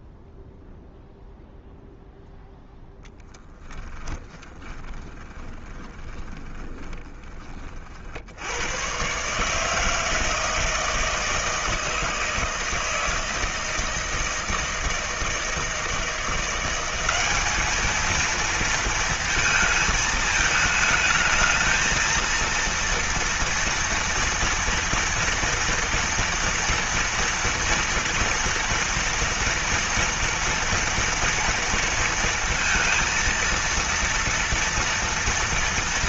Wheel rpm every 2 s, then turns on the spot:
0, 0, 20, 20, 90, 160, 160, 160, 180, 230, 220, 230, 230, 230, 230, 230, 230, 230.
4-8